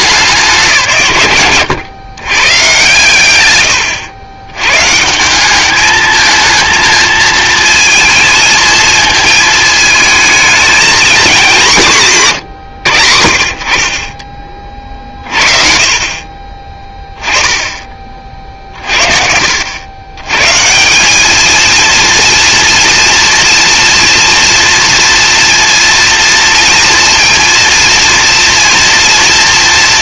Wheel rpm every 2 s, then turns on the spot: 150, 120, 120, 220, 230, 230, 100, 40, 20, 60, 160, 230, 240, 230, 230.
none